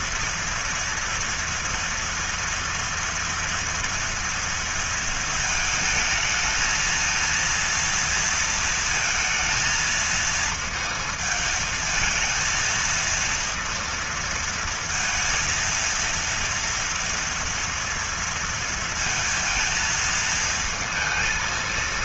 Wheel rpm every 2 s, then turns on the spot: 230, 230, 230, 220, 220, 220, 230, 230, 230, 230, 220.
none